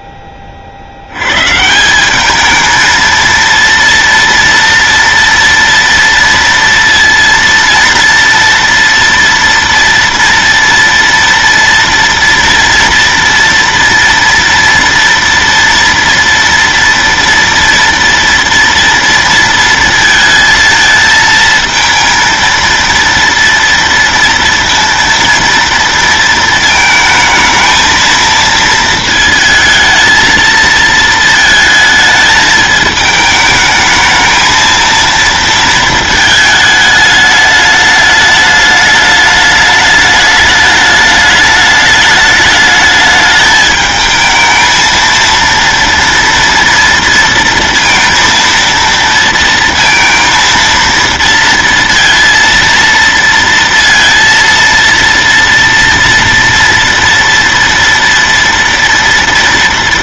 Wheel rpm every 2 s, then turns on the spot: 30, 210, 230, 230, 230, 230, 230, 230, 230, 230, 220, 230, 230, 230, 230, 230, 220, 220, 220, 210, 210, 210, 220, 230, 230, 230, 230, 230, 230, 230.
none